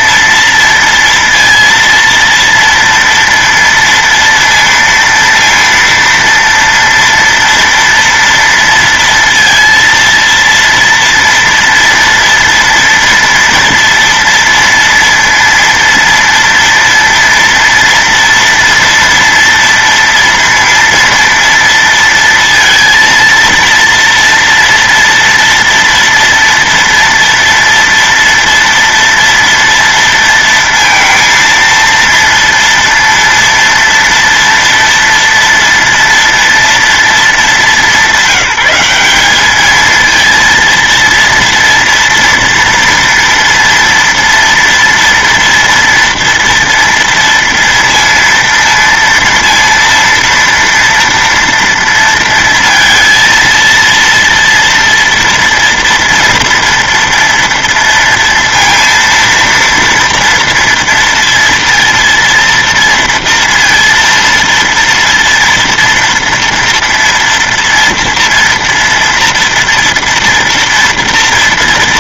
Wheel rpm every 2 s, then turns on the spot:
230, 230, 230, 230, 230, 230, 230, 230, 230, 230, 230, 230, 230, 230, 230, 230, 230, 230, 230, 190, 230, 230, 230, 230, 230, 230, 230, 230, 230, 230, 230, 230, 230, 230, 230, 230.
none